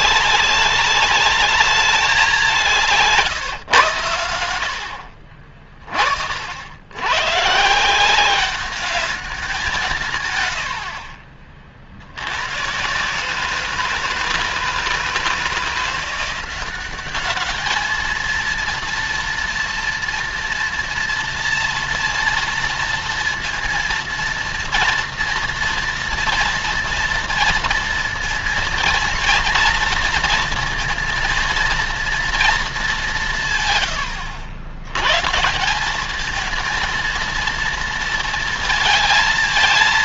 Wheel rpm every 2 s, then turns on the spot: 190, 190, 90, 70, 190, 110, 120, 160, 180, 220, 240, 230, 230, 230, 230, 230, 220, 90, 220, 230.
none